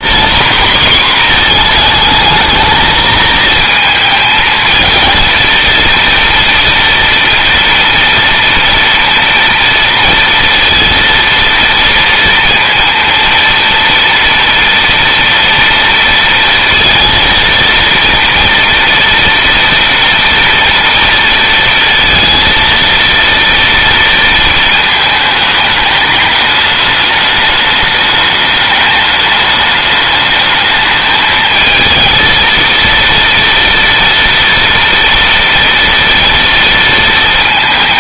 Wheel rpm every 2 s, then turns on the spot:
240, 220, 220, 230, 230, 230, 230, 230, 230, 230, 230, 230, 220, 210, 210, 220, 230, 230, 230.
none